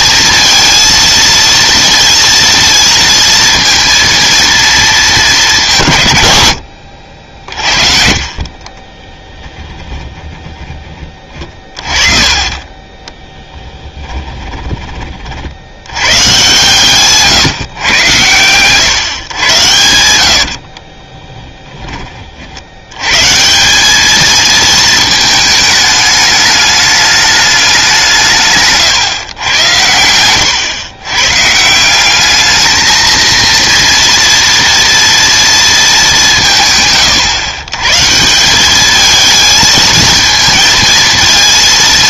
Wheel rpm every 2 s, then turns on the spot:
230, 230, 220, 90, 30, 10, 30, 20, 140, 120, 60, 70, 220, 210, 140, 110, 220, 240, 150, 190, 230.
14-16 20-22